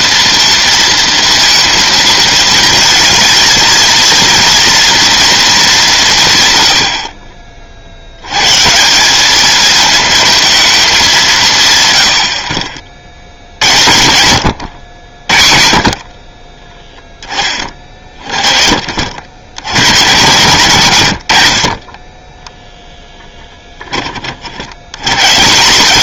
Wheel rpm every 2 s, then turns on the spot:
230, 220, 230, 130, 160, 210, 60, 90, 20, 40, 100, 10, 100.
22-24